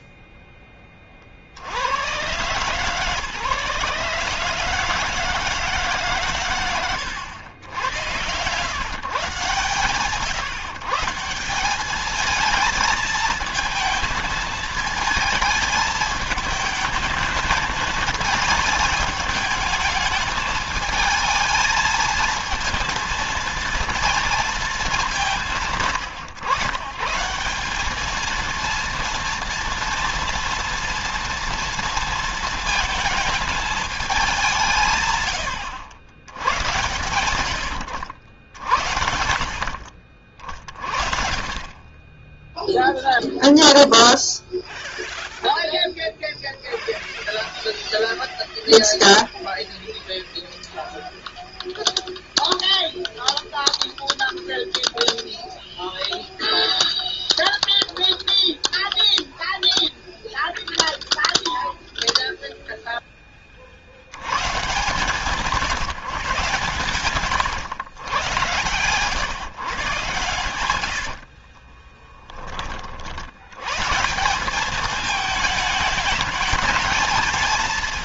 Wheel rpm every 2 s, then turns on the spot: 10, 120, 150, 120, 120, 140, 220, 220, 220, 220, 220, 230, 220, 110, 230, 230, 230, 180, 100, 80, 50, 20, 0, 0, 0, 0, 0, 0, 0, 0, 0, 0, 130, 150, 120, 100, 30, 190, 220.
70-72